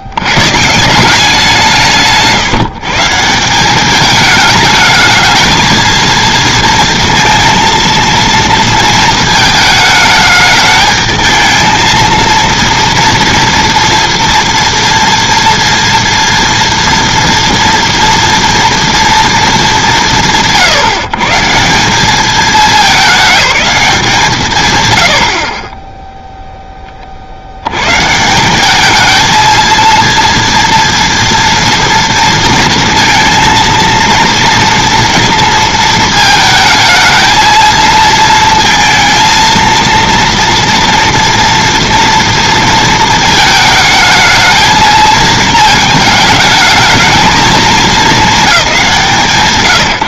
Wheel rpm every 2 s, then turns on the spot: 170, 160, 210, 230, 220, 220, 230, 240, 230, 230, 150, 210, 90, 20, 200, 230, 230, 230, 220, 230, 230, 230, 220, 220, 190.
none